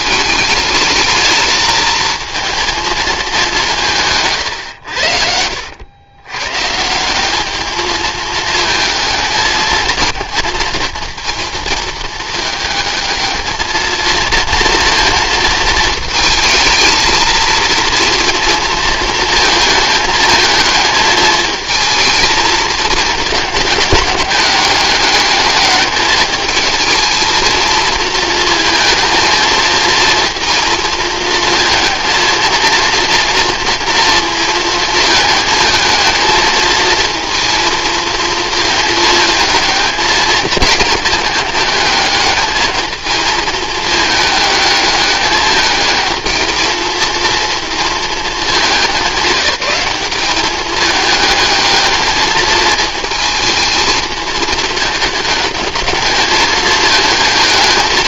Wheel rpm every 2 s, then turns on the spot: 220, 230, 100, 150, 220, 230, 220, 230, 220, 230, 220, 220, 200, 220, 230, 230, 230, 220, 220, 220, 220, 220, 210, 230, 200, 210, 220, 210, 220.
none